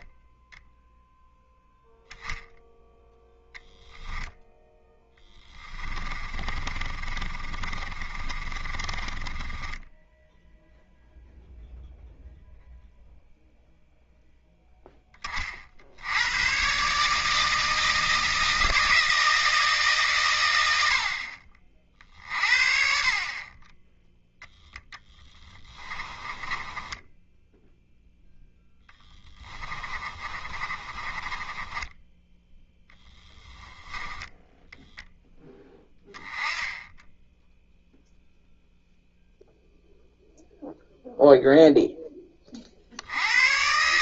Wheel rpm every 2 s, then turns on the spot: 0, 0, 10, 30, 30, 0, 0, 10, 130, 160, 70, 50, 10, 10, 10, 30, 10, 0, 10, 0, 0, 70.
4-10 26-28 30-34